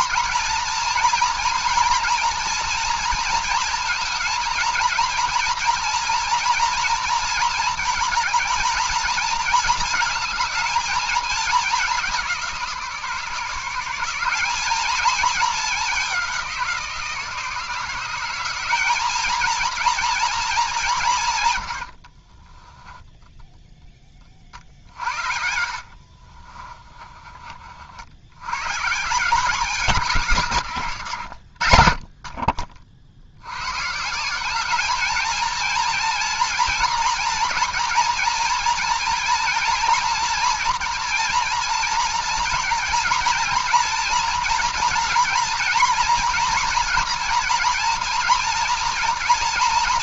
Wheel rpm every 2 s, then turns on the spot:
230, 230, 230, 230, 220, 220, 170, 200, 180, 190, 210, 20, 50, 30, 110, 140, 40, 190, 230, 230, 240, 230, 230, 230, 230.
22-28 30-32